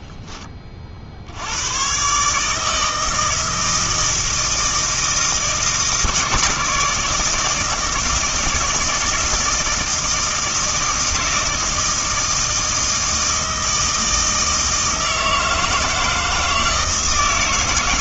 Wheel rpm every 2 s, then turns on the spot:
20, 160, 160, 150, 160, 160, 160, 160, 160.
none